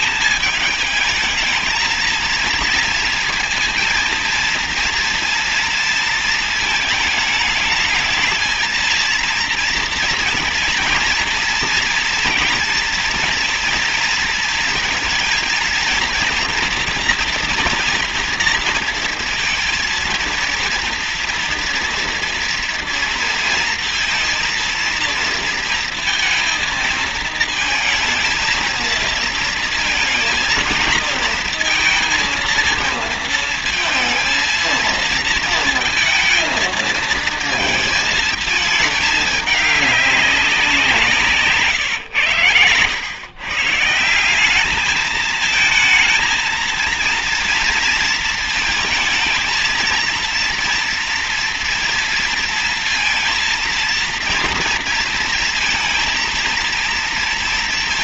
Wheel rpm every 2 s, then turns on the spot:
210, 230, 230, 220, 220, 240, 230, 230, 230, 230, 230, 230, 230, 230, 230, 220, 230, 230, 220, 230, 190, 120, 200, 230, 220, 230, 230, 230, 230.
none